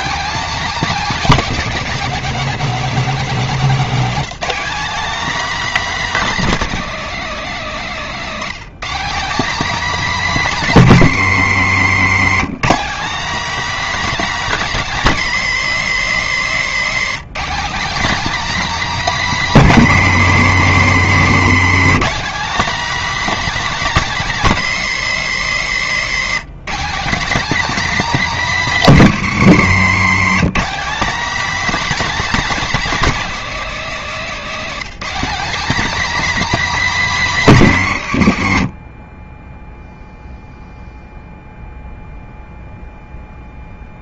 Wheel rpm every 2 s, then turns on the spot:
260, 230, 250, 210, 220, 180, 240, 230, 220, 250, 200, 270, 210, 230, 190, 250, 250, 240, 230, 30, 0, 0.
none